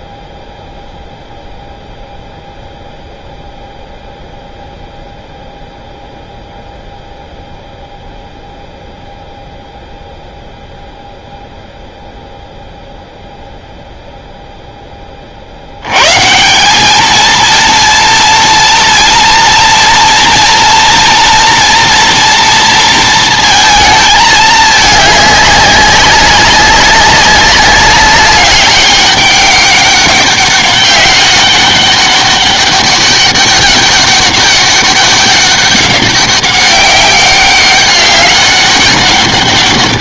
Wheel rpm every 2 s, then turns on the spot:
0, 0, 0, 0, 0, 0, 0, 0, 80, 230, 230, 240, 230, 200, 200, 200, 200, 200, 200, 200.
none